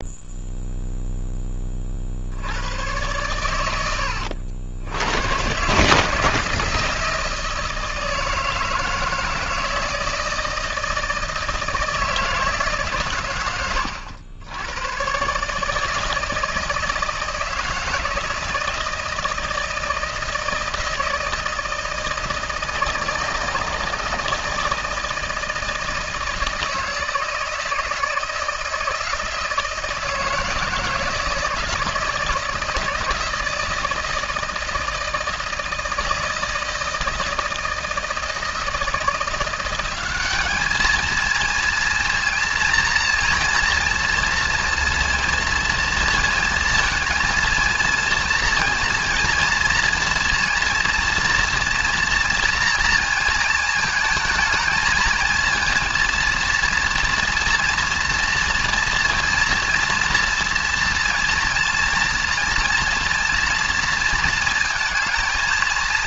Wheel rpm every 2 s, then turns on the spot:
0, 90, 90, 160, 160, 160, 150, 100, 160, 160, 160, 160, 160, 160, 160, 160, 160, 160, 160, 160, 210, 230, 230, 230, 230, 230, 230, 220, 230, 230, 230, 230, 220.
none